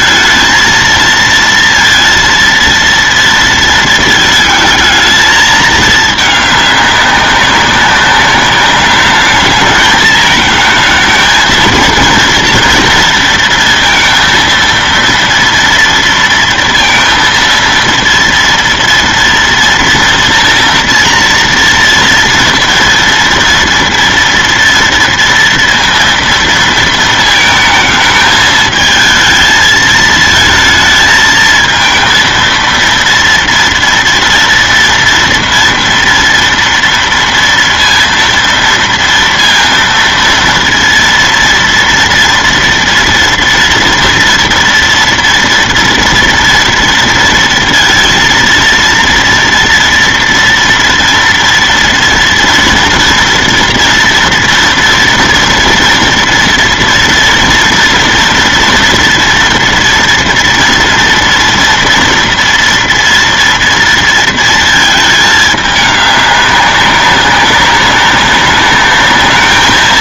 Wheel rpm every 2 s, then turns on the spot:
230, 230, 220, 210, 200, 220, 230, 230, 230, 230, 230, 230, 230, 230, 220, 220, 230, 230, 230, 230, 230, 230, 230, 230, 230, 230, 230, 240, 230, 230, 230, 230, 230, 200, 200.
none